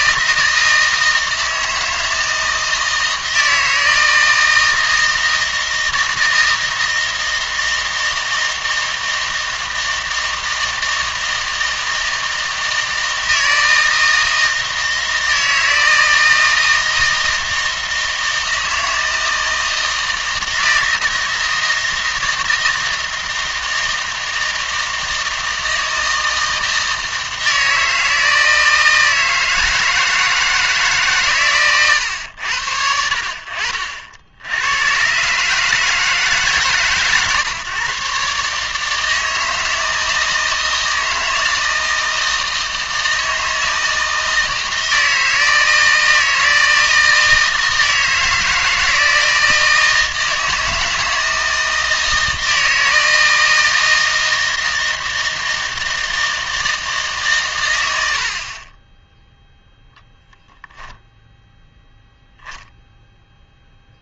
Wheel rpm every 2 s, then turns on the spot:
160, 160, 160, 160, 160, 160, 160, 160, 160, 160, 160, 160, 160, 160, 160, 160, 80, 100, 140, 150, 160, 160, 160, 160, 160, 160, 160, 160, 160, 20, 0, 10.
none